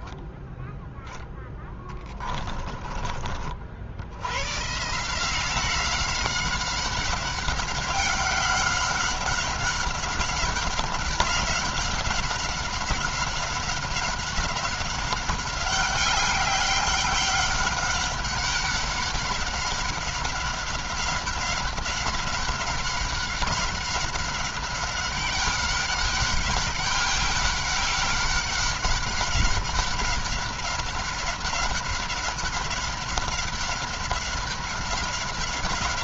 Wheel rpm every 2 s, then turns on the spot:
10, 20, 140, 190, 190, 200, 190, 190, 190, 190, 190, 190, 190, 190, 200, 200, 190, 190.
none